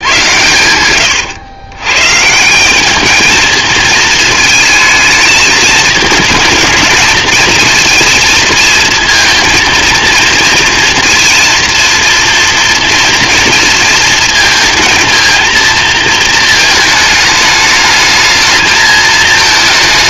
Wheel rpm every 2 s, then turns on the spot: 100, 190, 230, 220, 220, 230, 230, 220, 220, 220.
none